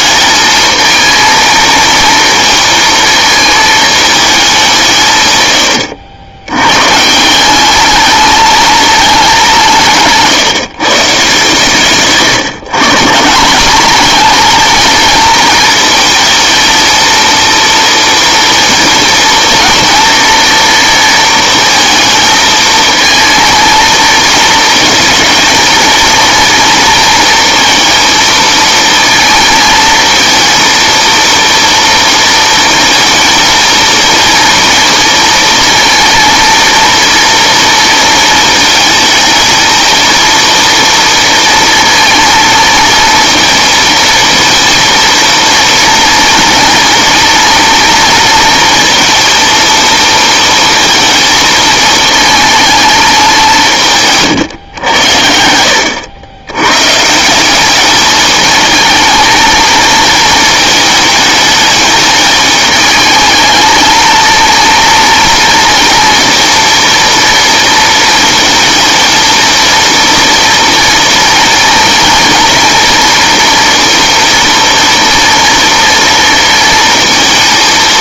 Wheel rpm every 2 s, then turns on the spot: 220, 230, 160, 120, 210, 150, 150, 230, 230, 230, 230, 220, 220, 230, 230, 230, 220, 230, 230, 220, 230, 220, 230, 230, 230, 230, 220, 120, 120, 220, 220, 210, 230, 230, 220, 230, 220, 230, 230.
none